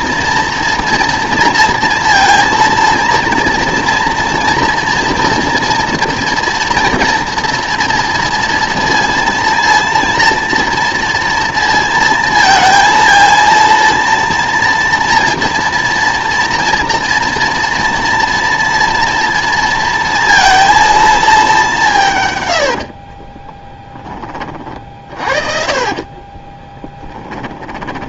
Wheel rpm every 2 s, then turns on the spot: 230, 230, 230, 230, 230, 230, 230, 230, 240, 230, 230, 80, 40, 20.
22-28